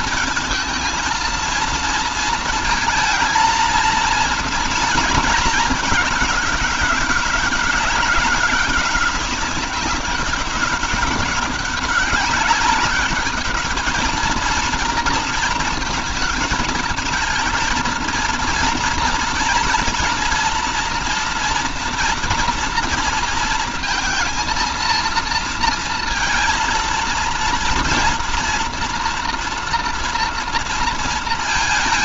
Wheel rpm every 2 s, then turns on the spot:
220, 230, 230, 210, 190, 200, 200, 220, 230, 230, 240, 230, 230, 230, 230, 230.
none